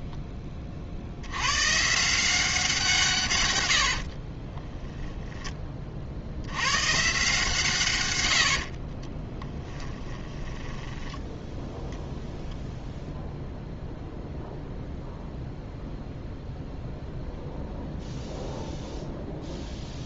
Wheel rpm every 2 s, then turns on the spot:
30, 170, 10, 110, 60, 10, 0, 0, 0, 0.
4-6 8-12